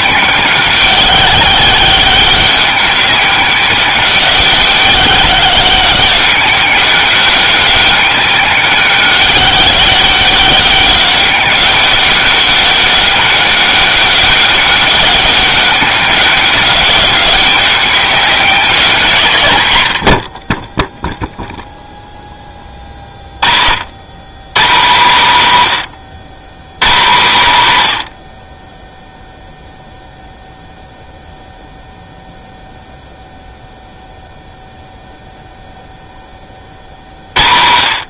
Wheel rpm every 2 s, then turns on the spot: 200, 200, 200, 200, 190, 200, 200, 200, 190, 170, 10, 20, 150, 130, 20, 0, 0, 0, 40.
none